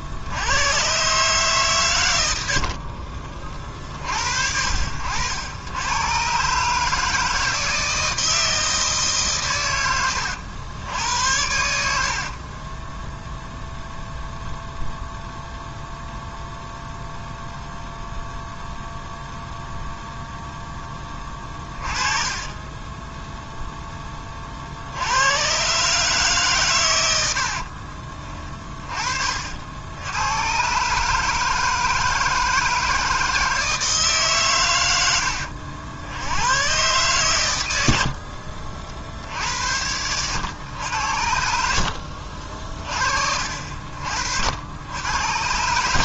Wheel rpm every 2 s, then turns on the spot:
130, 50, 80, 150, 150, 80, 10, 0, 0, 0, 10, 10, 70, 100, 40, 140, 160, 100, 120, 70, 80, 40, 90.
2-4